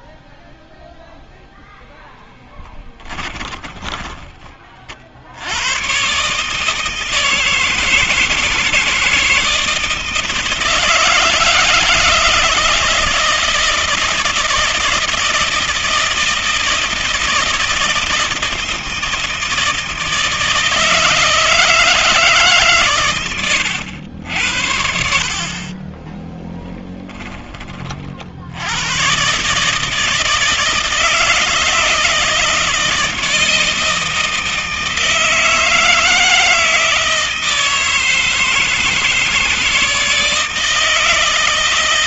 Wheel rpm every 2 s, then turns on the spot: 0, 10, 40, 150, 170, 160, 160, 160, 160, 160, 160, 140, 60, 10, 80, 160, 160, 160, 160, 160, 160.
2-4